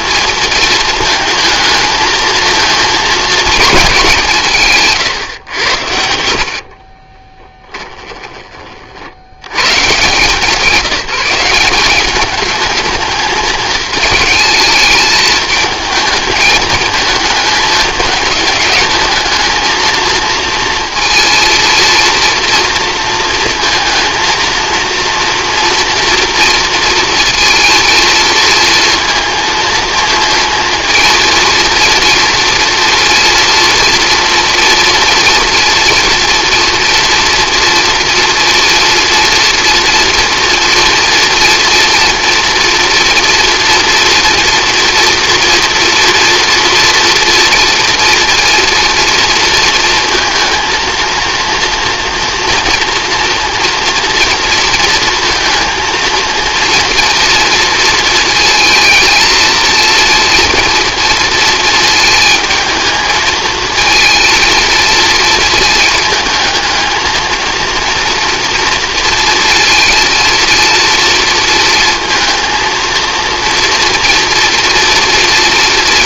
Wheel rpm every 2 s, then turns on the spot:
220, 220, 140, 40, 40, 180, 220, 220, 220, 210, 230, 230, 230, 230, 230, 230, 230, 230, 230, 230, 230, 240, 240, 230, 240, 230, 230, 230, 230, 220, 230, 220, 220, 220, 230, 230, 230, 230.
6-8